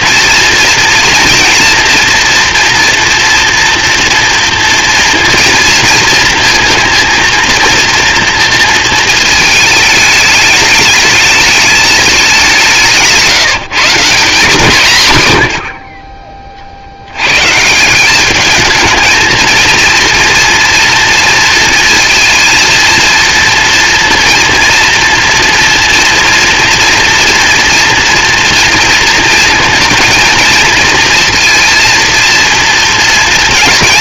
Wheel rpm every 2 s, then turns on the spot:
230, 240, 230, 230, 230, 220, 160, 150, 70, 220, 230, 230, 230, 230, 230, 230, 220.
none